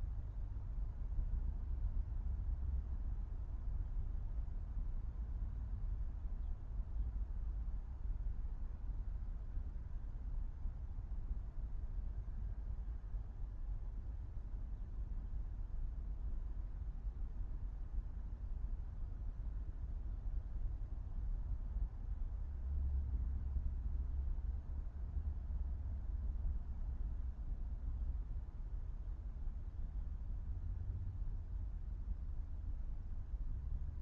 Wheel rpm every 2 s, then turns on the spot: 0, 0, 0, 0, 0, 0, 0, 0, 0, 0, 0, 0, 0, 0, 0, 0, 0.
none